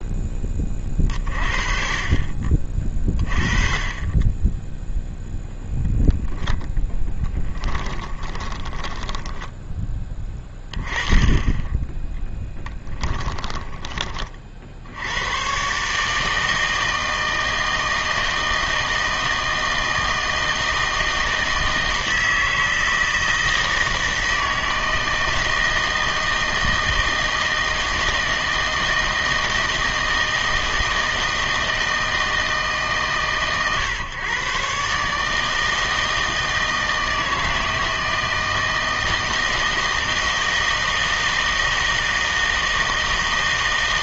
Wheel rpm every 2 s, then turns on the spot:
30, 40, 0, 10, 20, 20, 10, 60, 160, 160, 160, 160, 160, 160, 160, 160, 160, 130, 160, 160, 160, 160.
8-10 12-14